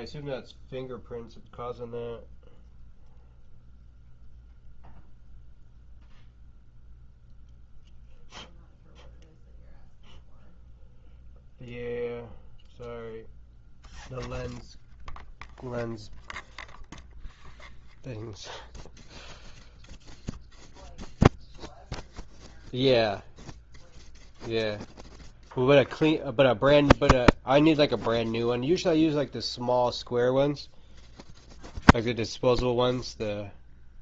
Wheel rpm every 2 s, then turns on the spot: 0, 0, 0, 0, 0, 0, 0, 0, 0, 0, 0, 0, 0, 0, 0, 0, 0.
none